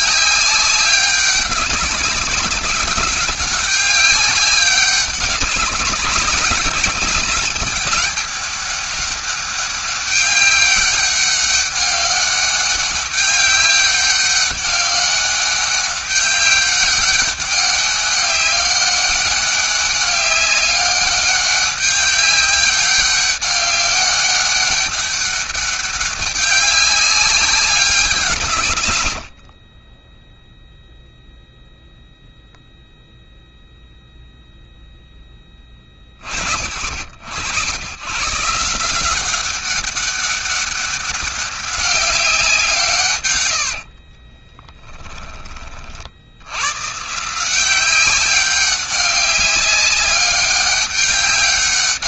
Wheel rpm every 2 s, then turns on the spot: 200, 190, 190, 190, 200, 200, 200, 200, 200, 200, 200, 200, 200, 200, 120, 0, 0, 0, 70, 170, 200, 170, 30, 110, 200, 200.
44-46